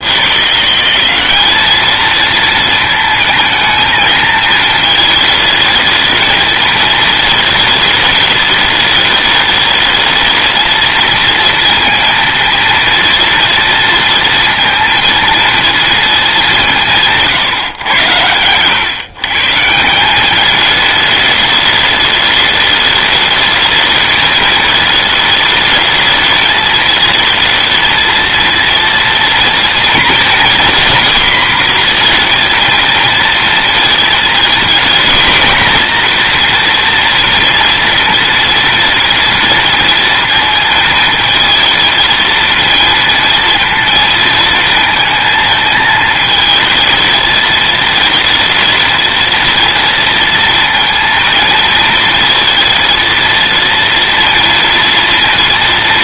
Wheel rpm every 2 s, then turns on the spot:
190, 230, 220, 220, 210, 220, 230, 230, 190, 140, 210, 210, 220, 220, 230, 240, 230, 240, 230, 230, 220, 230, 220, 220, 230, 230, 230, 240.
none